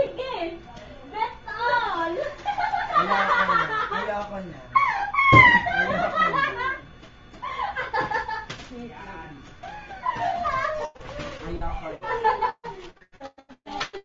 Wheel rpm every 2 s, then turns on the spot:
0, 0, 0, 0, 0, 0, 0.
none